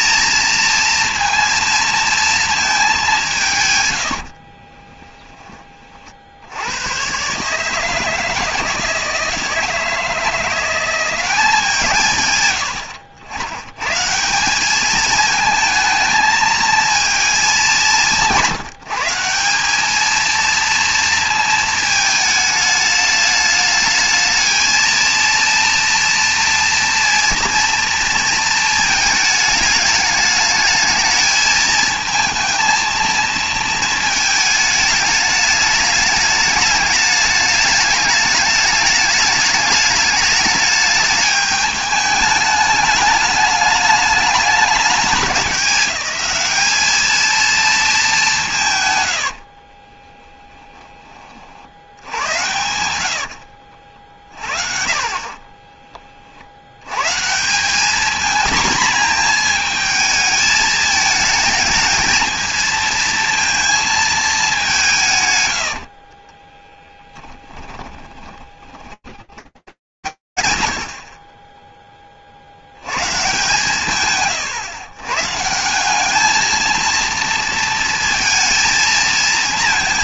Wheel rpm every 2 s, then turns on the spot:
230, 220, 30, 90, 160, 170, 110, 200, 220, 170, 230, 210, 220, 230, 220, 210, 230, 220, 210, 210, 210, 210, 210, 210, 140, 30, 90, 50, 80, 230, 220, 220, 200, 20, 10, 120, 50, 120, 220, 220.
4-6 50-54 66-70